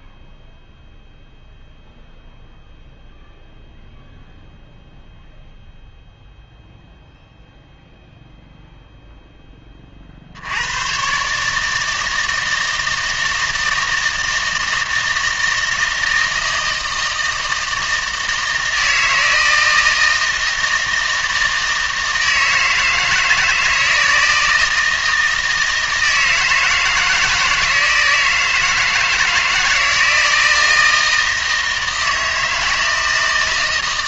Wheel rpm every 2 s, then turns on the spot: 0, 0, 0, 0, 0, 110, 160, 160, 160, 160, 160, 160, 160, 160, 160, 160, 160.
none